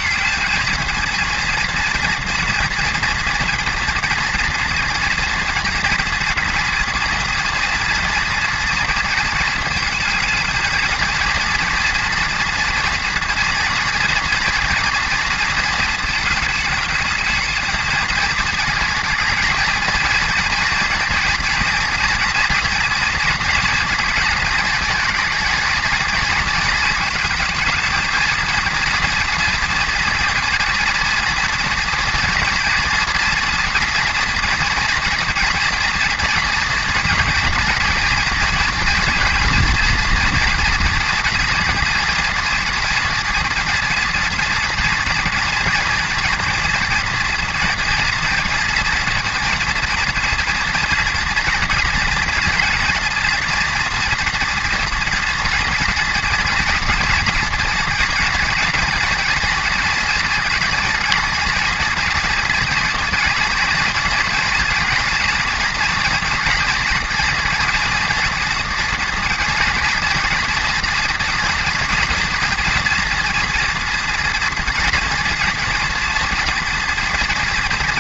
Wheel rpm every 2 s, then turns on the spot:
230, 230, 240, 240, 230, 230, 240, 240, 210, 230, 230, 230, 230, 220, 230, 230, 230, 230, 230, 240, 230, 230, 230, 240, 230, 240, 230, 230, 230, 230, 230, 230, 240, 230, 230, 230, 240, 230, 230.
none